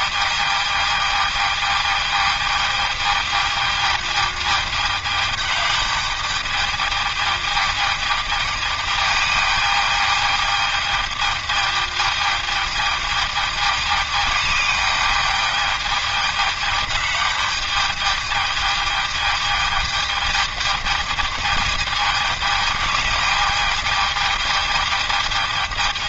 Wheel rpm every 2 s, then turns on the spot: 220, 220, 210, 210, 210, 210, 220, 210, 210, 210, 210, 210, 220.
none